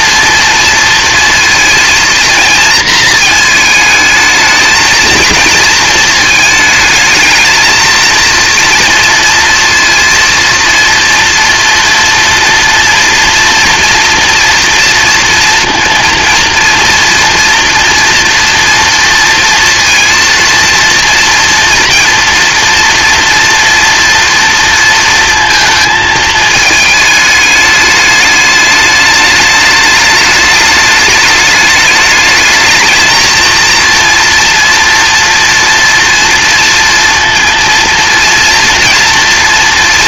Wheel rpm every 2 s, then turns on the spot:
230, 230, 230, 220, 230, 230, 230, 230, 230, 230, 230, 230, 230, 210, 210, 210, 220, 230, 230, 230.
none